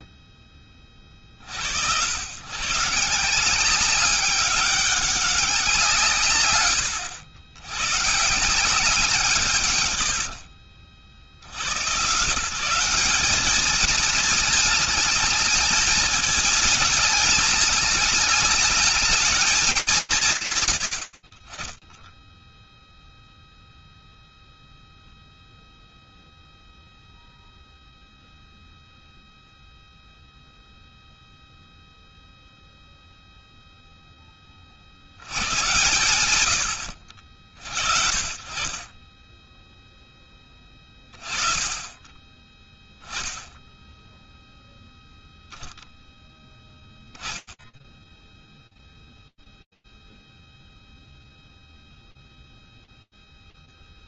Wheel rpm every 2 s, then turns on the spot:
10, 90, 190, 150, 160, 80, 140, 220, 220, 220, 150, 10, 0, 0, 0, 0, 0, 60, 60, 20, 20, 10, 0, 0, 0, 0, 0.
10-12